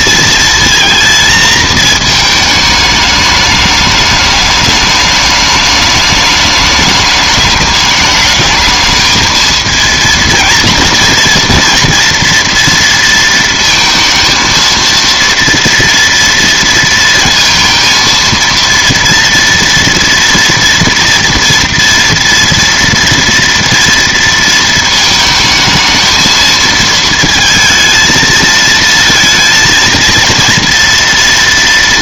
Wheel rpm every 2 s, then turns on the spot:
230, 210, 210, 210, 220, 230, 230, 230, 230, 230, 230, 230, 220, 220, 230, 230.
none